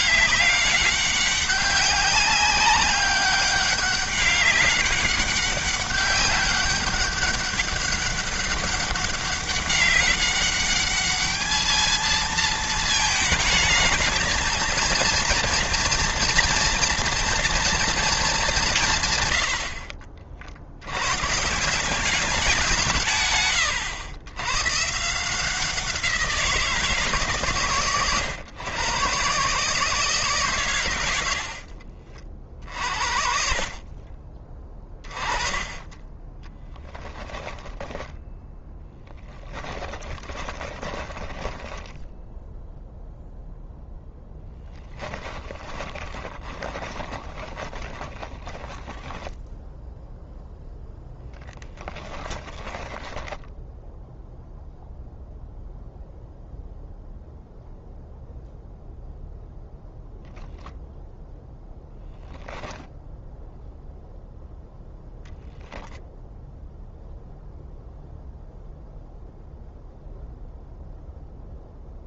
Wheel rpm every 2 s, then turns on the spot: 200, 200, 200, 200, 200, 210, 220, 230, 240, 140, 100, 160, 150, 160, 130, 90, 50, 20, 10, 10, 20, 0, 10, 20, 10, 10, 10, 0, 0, 0, 0, 0, 0, 0, 0, 0.
36-42 44-50 52-54